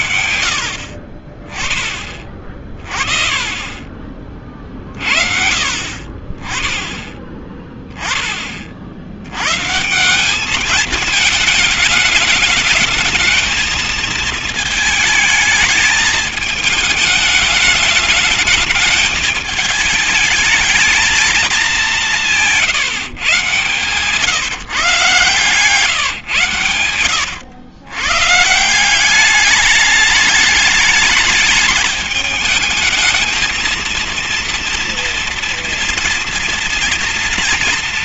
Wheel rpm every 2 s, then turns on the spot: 70, 30, 30, 30, 30, 210, 210, 220, 210, 210, 220, 180, 150, 130, 150, 210, 220, 230, 230.
none